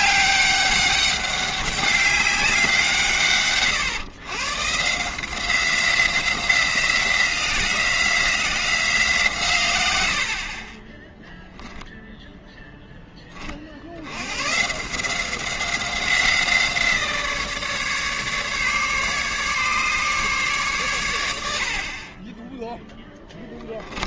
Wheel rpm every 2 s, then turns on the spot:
200, 170, 150, 180, 170, 20, 10, 160, 170, 150, 120, 10.
none